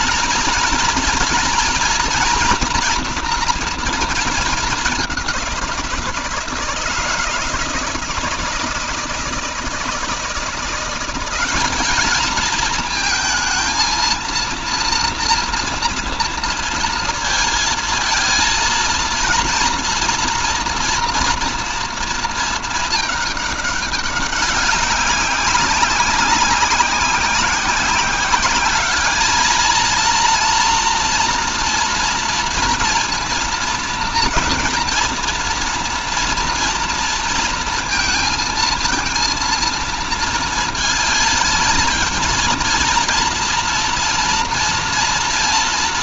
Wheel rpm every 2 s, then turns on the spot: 230, 240, 210, 160, 160, 180, 230, 230, 230, 230, 230, 220, 200, 190, 200, 230, 230, 230, 230, 220, 230, 230, 230.
none